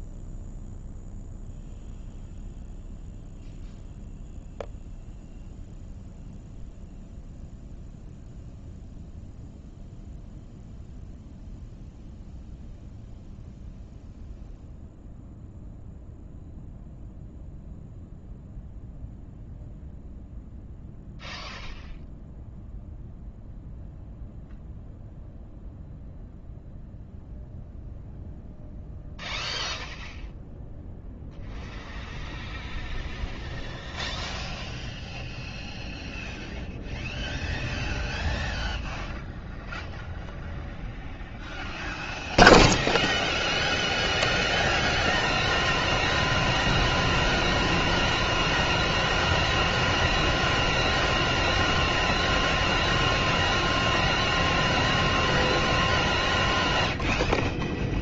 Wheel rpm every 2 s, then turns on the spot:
0, 0, 0, 0, 0, 0, 0, 0, 0, 0, 0, 0, 0, 0, 0, 0, 0, 0, 0, 0, 0, 0, 0, 0, 0, 0, 0, 0, 0.
none